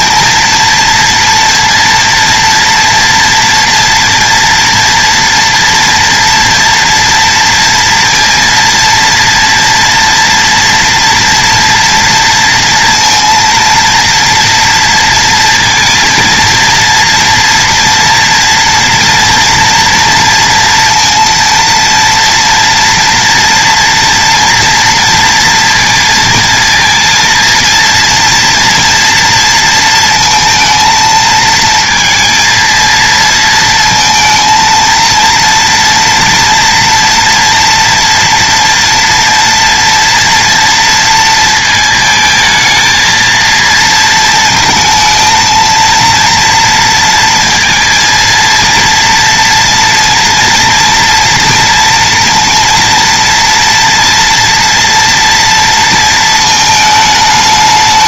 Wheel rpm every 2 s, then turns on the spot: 230, 230, 230, 230, 230, 230, 230, 230, 230, 230, 230, 230, 230, 230, 230, 220, 230, 230, 240, 230, 230, 220, 230, 230, 230, 230, 230, 240, 220.
none